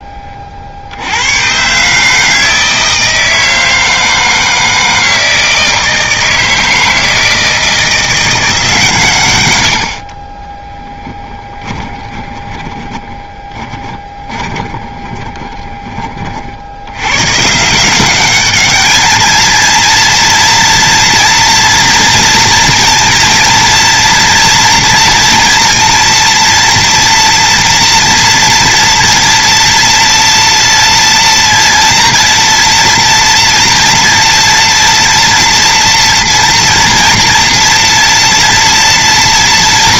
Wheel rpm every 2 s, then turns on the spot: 50, 160, 160, 160, 150, 0, 10, 20, 70, 210, 230, 230, 230, 230, 230, 230, 230, 230, 230, 230.
12-16